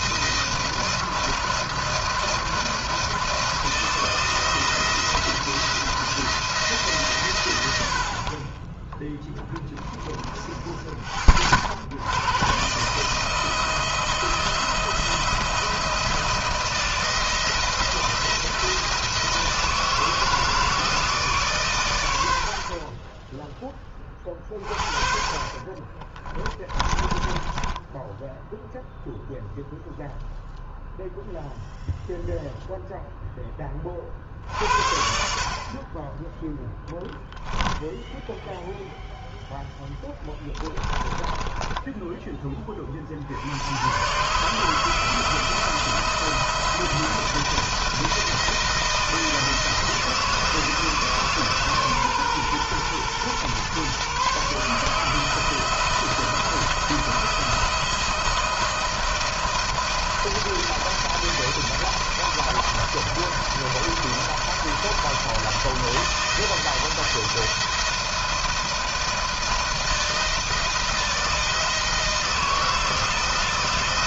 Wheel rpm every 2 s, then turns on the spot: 160, 160, 170, 140, 10, 40, 150, 160, 170, 170, 160, 30, 40, 20, 0, 0, 0, 70, 10, 0, 10, 40, 160, 160, 160, 160, 120, 150, 170, 170, 170, 160, 160, 160, 170, 170, 160.
26-28 36-38 40-42